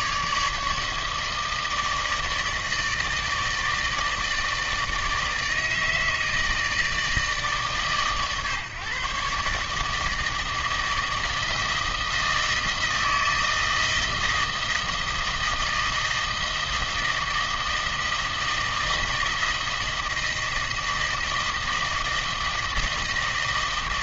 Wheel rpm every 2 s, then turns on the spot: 150, 160, 160, 160, 140, 160, 160, 160, 160, 160, 160, 160.
none